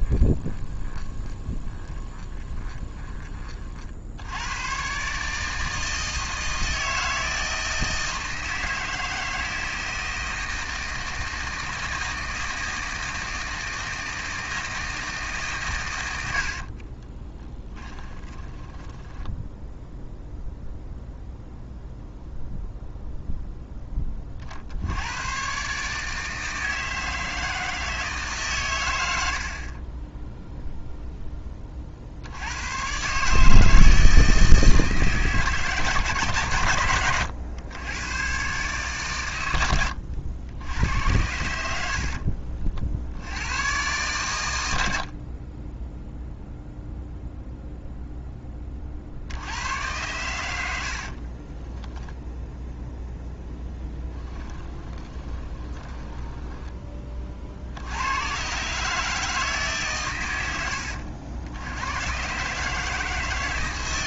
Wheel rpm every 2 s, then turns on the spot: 20, 20, 100, 160, 160, 160, 160, 160, 50, 10, 0, 0, 60, 160, 120, 0, 110, 160, 110, 130, 80, 50, 100, 0, 30, 90, 0, 10, 20, 130, 90, 150.
0-4 16-20 54-56